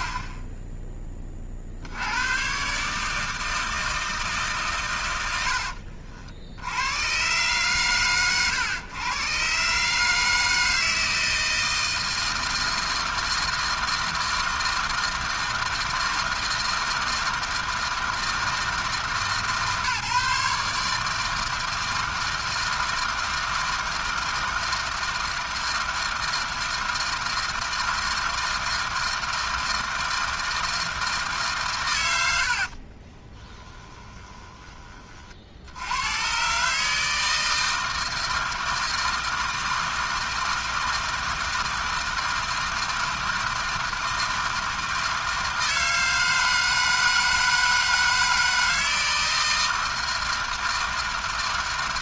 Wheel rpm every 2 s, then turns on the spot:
80, 160, 40, 110, 140, 160, 160, 160, 160, 150, 160, 160, 160, 160, 160, 150, 30, 40, 160, 160, 160, 160, 160, 160, 160, 160.
32-34